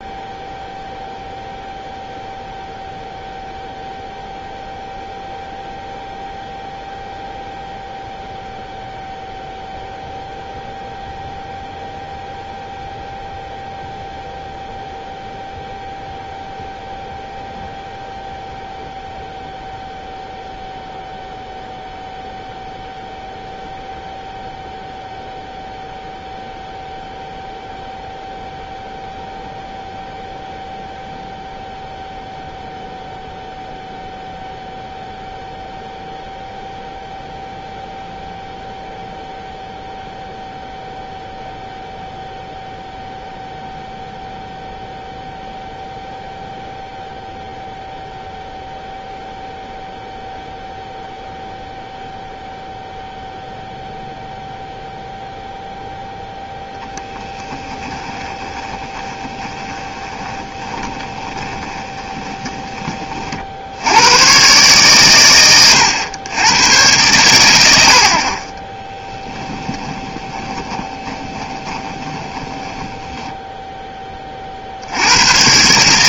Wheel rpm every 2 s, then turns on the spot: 0, 0, 0, 0, 0, 0, 0, 0, 0, 0, 0, 0, 0, 0, 0, 0, 0, 0, 0, 0, 0, 0, 0, 0, 0, 0, 0, 0, 0, 20, 20, 20, 130, 110, 30, 20, 20, 60.
58-64 70-74